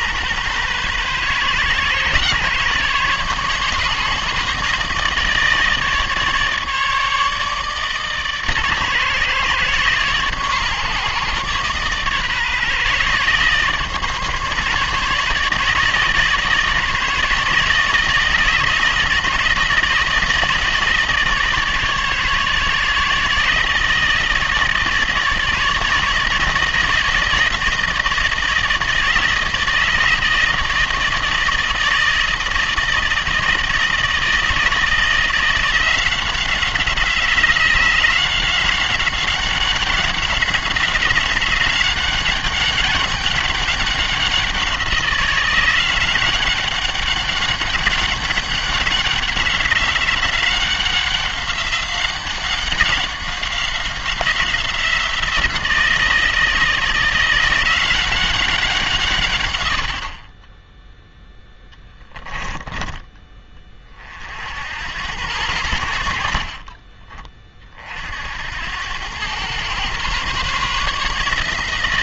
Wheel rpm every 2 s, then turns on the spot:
130, 140, 150, 150, 140, 140, 140, 150, 160, 160, 160, 150, 160, 160, 160, 160, 160, 160, 180, 190, 190, 200, 180, 190, 200, 190, 190, 180, 160, 170, 10, 20, 70, 40, 90, 140.
66-68